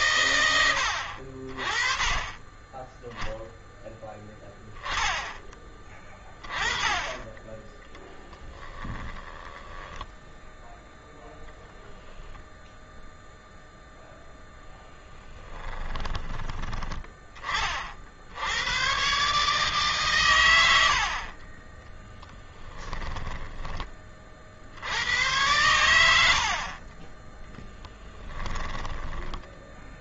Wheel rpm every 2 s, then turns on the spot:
120, 20, 10, 20, 20, 0, 0, 20, 20, 80, 110, 10, 40, 70, 10.
8-10 22-24 26-30